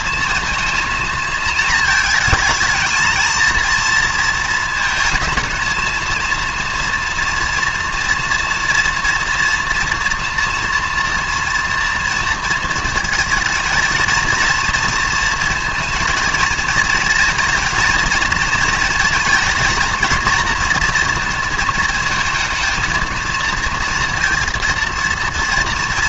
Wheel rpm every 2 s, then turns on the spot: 230, 220, 220, 230, 230, 230, 230, 230, 230, 230, 230, 230, 230.
none